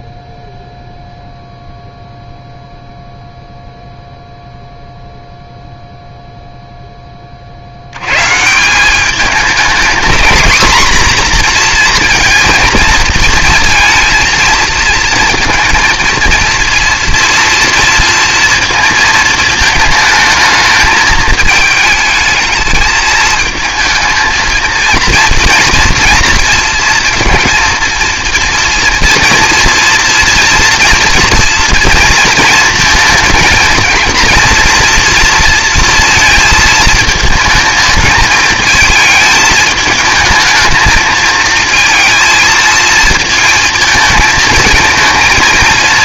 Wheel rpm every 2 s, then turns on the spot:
0, 0, 0, 0, 170, 240, 230, 230, 230, 230, 220, 220, 220, 230, 230, 240, 220, 230, 230, 220, 220, 230, 220.
none